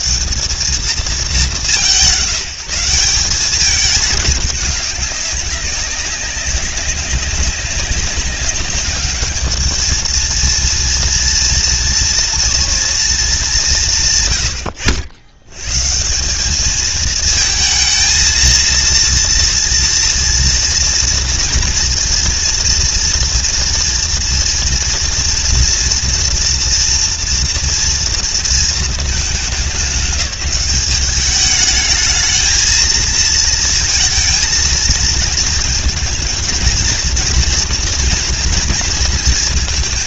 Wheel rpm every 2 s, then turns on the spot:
180, 190, 200, 190, 210, 230, 230, 90, 220, 230, 230, 230, 240, 230, 230, 200, 220, 230, 230, 230.
none